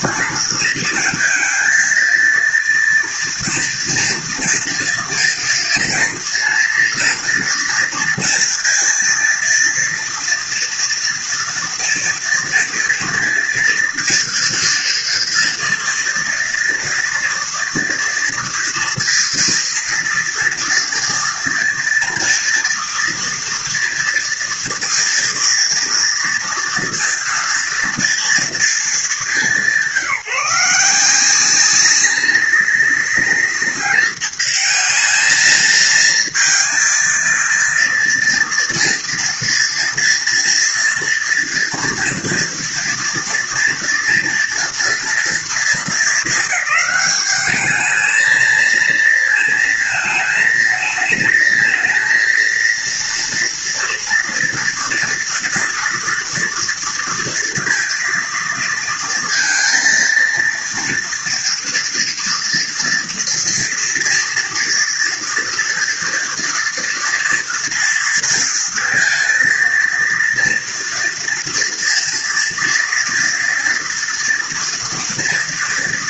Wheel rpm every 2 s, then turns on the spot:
230, 230, 230, 230, 230, 230, 230, 230, 230, 230, 230, 230, 230, 230, 220, 180, 200, 220, 230, 230, 230, 240, 230, 210, 230, 220, 230, 230, 230, 230, 230, 230, 230, 230, 230, 230, 230, 230.
none